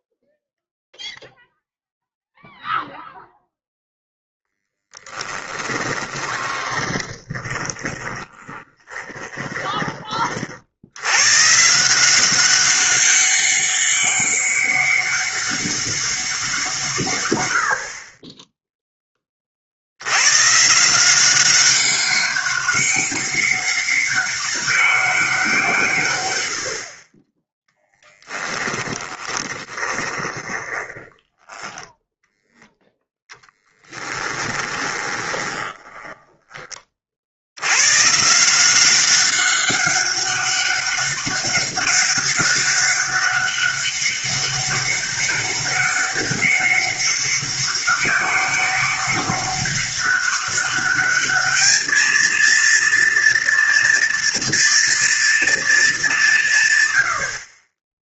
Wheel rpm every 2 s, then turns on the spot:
0, 0, 10, 20, 20, 70, 190, 200, 160, 10, 150, 200, 200, 70, 20, 30, 0, 20, 20, 170, 200, 200, 200, 200, 200, 200, 230, 240, 130.
4-10 28-32 34-36